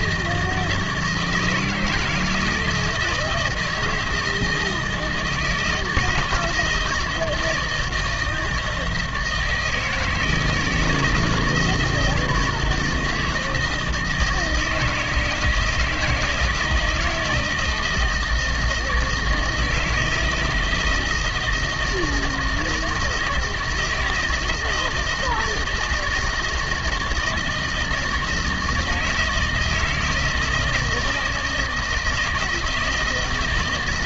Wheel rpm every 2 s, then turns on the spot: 160, 160, 160, 160, 160, 160, 160, 160, 170, 160, 160, 160, 160, 160, 160, 160, 160.
none